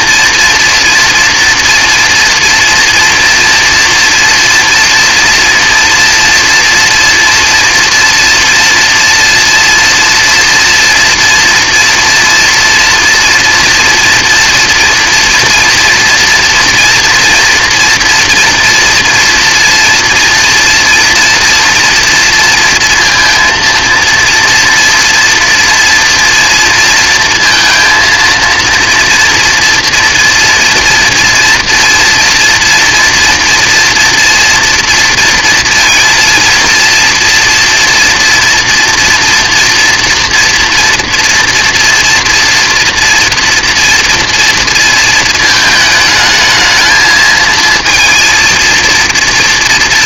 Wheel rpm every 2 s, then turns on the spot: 230, 230, 230, 240, 230, 240, 230, 240, 230, 230, 230, 230, 230, 230, 230, 230, 240, 230, 230, 240, 230, 230, 230, 220, 230.
none